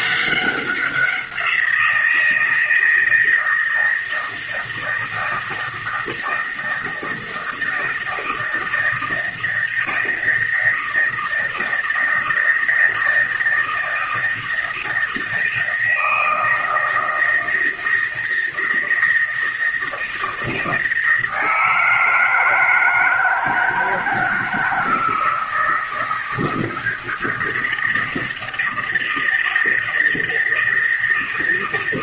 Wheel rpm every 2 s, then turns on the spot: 190, 160, 160, 160, 160, 160, 160, 160, 160, 160, 160, 160, 160, 160, 160, 160.
none